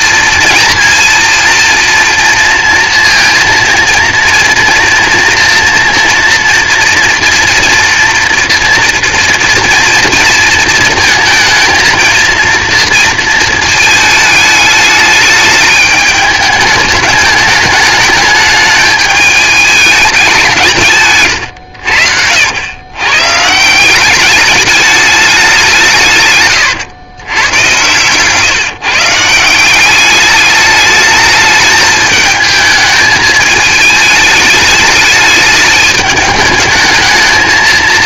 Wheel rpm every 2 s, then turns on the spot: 230, 230, 230, 240, 240, 230, 230, 210, 210, 210, 180, 90, 210, 110, 140, 210, 220, 210, 220.
none